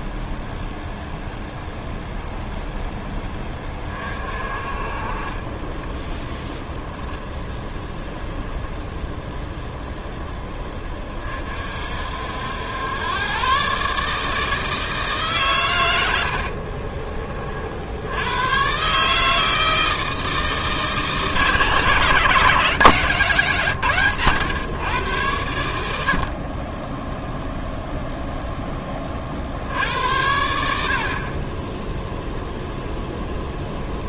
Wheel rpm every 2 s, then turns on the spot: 0, 10, 30, 0, 0, 20, 100, 150, 30, 130, 160, 180, 120, 20, 20, 60, 0.
16-18